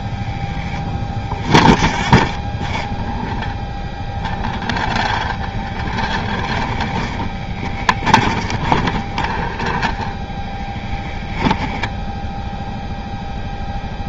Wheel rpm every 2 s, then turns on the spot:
0, 10, 0, 10, 20, 10, 0.
6-10